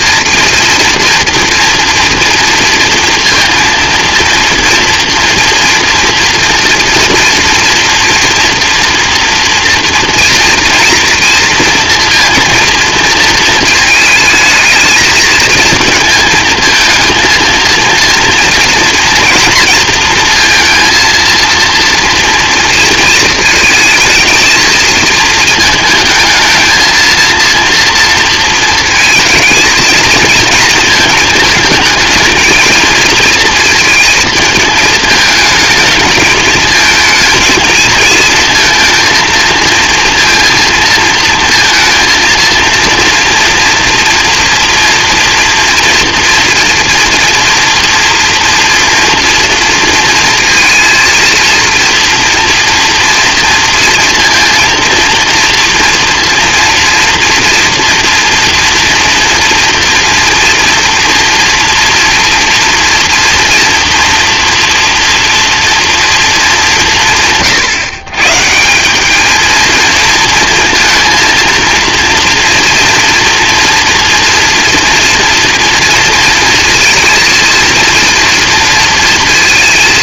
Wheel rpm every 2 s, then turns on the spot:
230, 230, 240, 240, 240, 230, 230, 220, 220, 240, 230, 230, 220, 230, 230, 220, 230, 220, 220, 230, 230, 230, 230, 230, 240, 230, 230, 230, 230, 230, 230, 230, 230, 150, 200, 230, 230, 240, 230, 230.
none